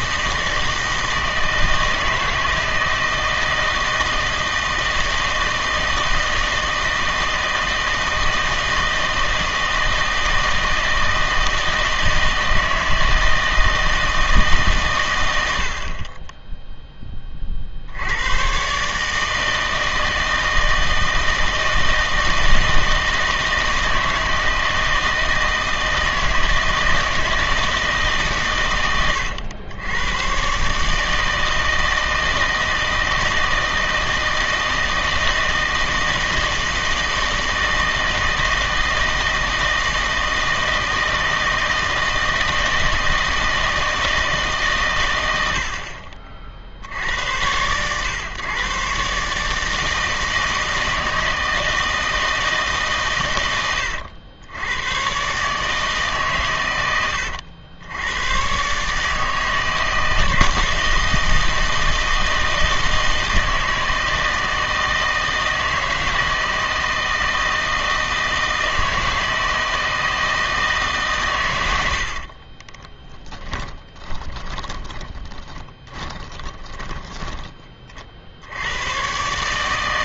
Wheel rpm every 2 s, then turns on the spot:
160, 160, 160, 160, 160, 160, 160, 140, 10, 130, 160, 160, 160, 160, 120, 140, 160, 160, 160, 160, 160, 160, 150, 60, 120, 160, 150, 100, 110, 130, 160, 160, 160, 160, 160, 160, 40, 20, 10, 80.
72-78